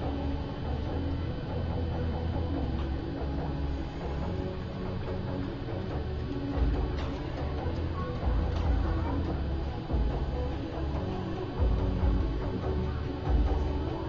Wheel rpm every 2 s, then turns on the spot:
0, 0, 0, 0, 0, 0, 0.
none